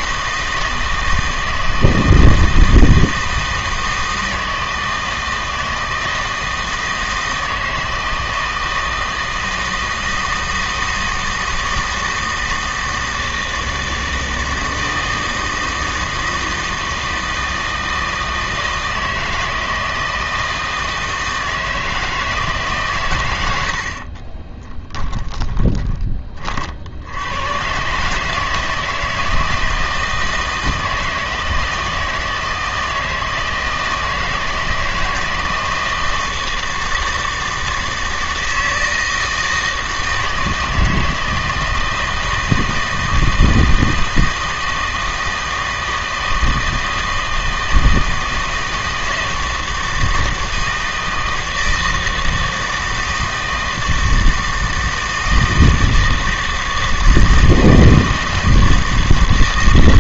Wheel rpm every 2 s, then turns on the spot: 160, 160, 160, 160, 160, 160, 160, 160, 160, 160, 160, 140, 20, 50, 160, 160, 160, 160, 160, 160, 160, 160, 160, 160, 160, 160, 160, 160, 160, 160.
24-26